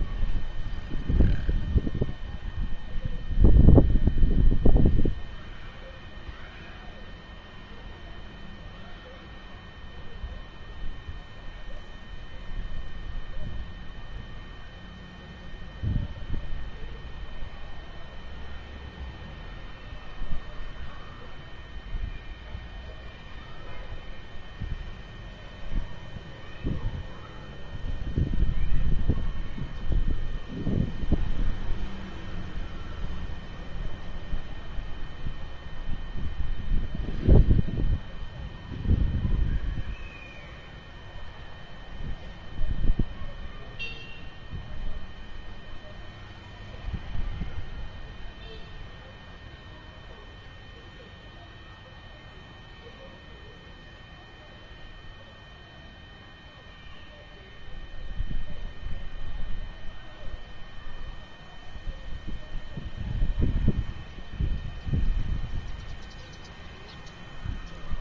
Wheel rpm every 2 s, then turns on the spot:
0, 0, 0, 0, 0, 0, 0, 0, 0, 0, 0, 0, 0, 0, 0, 0, 0, 0, 0, 0, 0, 0, 0, 0, 0, 0, 0, 0, 0, 0, 0, 0, 0, 0.
none